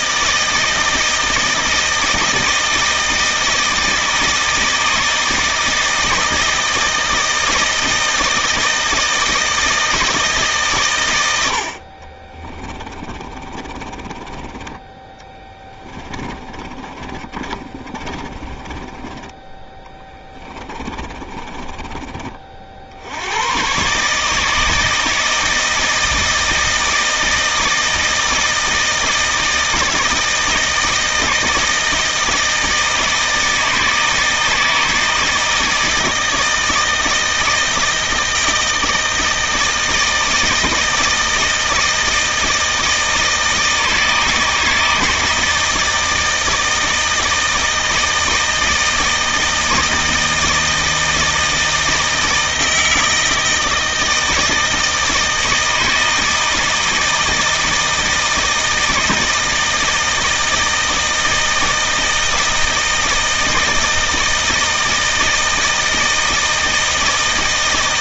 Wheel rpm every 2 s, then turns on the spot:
160, 160, 160, 160, 160, 140, 30, 20, 30, 20, 20, 60, 160, 160, 160, 160, 160, 160, 160, 160, 160, 160, 160, 160, 160, 160, 160, 160, 160, 160, 160, 160, 160, 160.
12-22